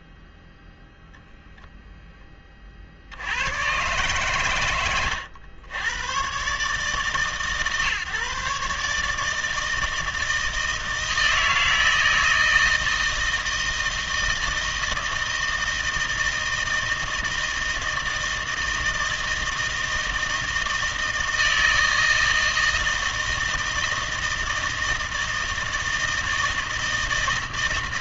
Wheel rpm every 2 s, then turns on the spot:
0, 40, 120, 140, 140, 160, 160, 160, 160, 160, 160, 160, 160, 160.
none